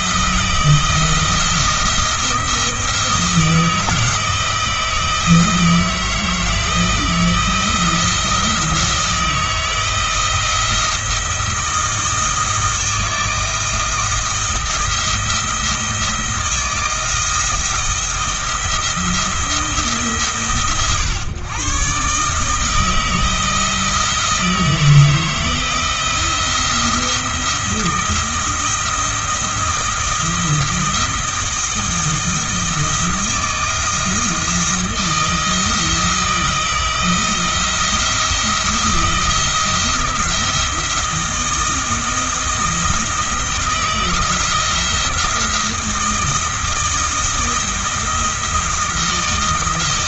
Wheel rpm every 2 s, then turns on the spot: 170, 160, 160, 160, 160, 170, 160, 170, 170, 170, 130, 160, 160, 170, 170, 170, 170, 160, 170, 170, 170, 170, 170, 160, 170.
none